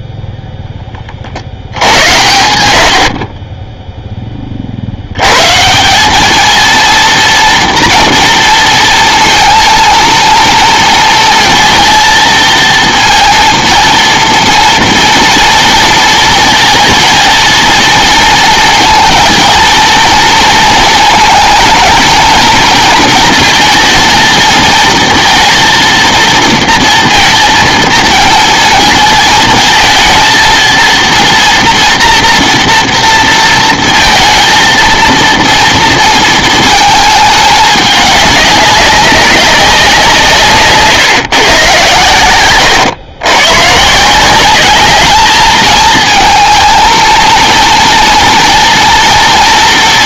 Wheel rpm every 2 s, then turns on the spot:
10, 80, 50, 220, 230, 230, 230, 230, 230, 230, 230, 230, 230, 230, 220, 230, 230, 230, 220, 200, 140, 110, 210, 220, 230.
none